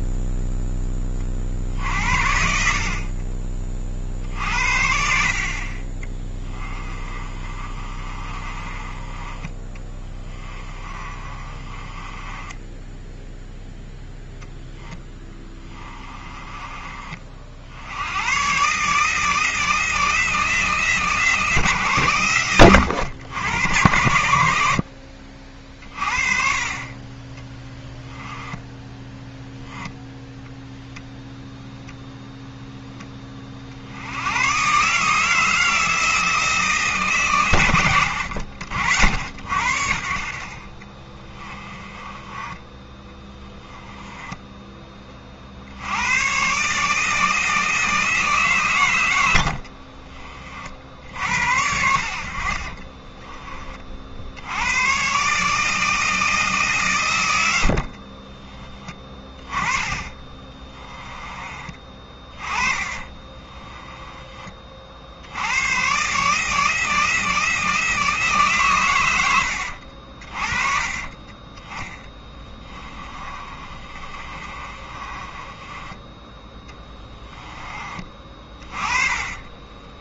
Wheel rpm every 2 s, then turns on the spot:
20, 50, 60, 20, 20, 30, 10, 10, 40, 150, 160, 100, 60, 30, 10, 0, 10, 150, 150, 70, 30, 30, 20, 150, 110, 60, 30, 120, 130, 20, 20, 20, 60, 160, 110, 30, 20, 30, 20, 20.
6-16 28-30 40-44 52-54 60-64 72-78